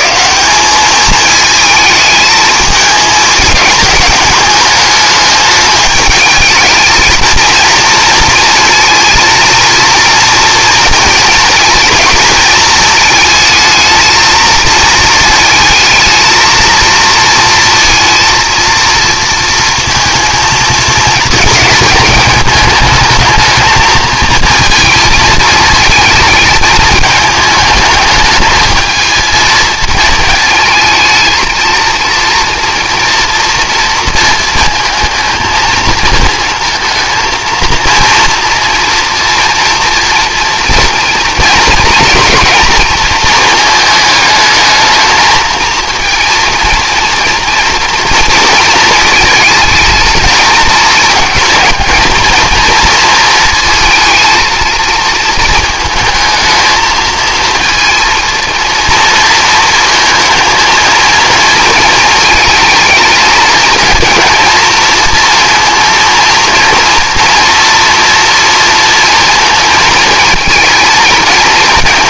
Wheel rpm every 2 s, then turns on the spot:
190, 220, 210, 220, 220, 230, 220, 220, 230, 230, 220, 220, 230, 220, 220, 220, 230, 230, 230, 230, 230, 230, 220, 230, 230, 220, 230, 220, 220, 230, 230, 220, 230, 230, 230, 220.
none